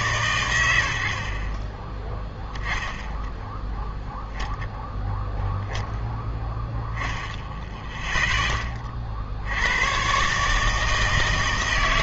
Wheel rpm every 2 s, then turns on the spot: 100, 10, 10, 10, 20, 150.
none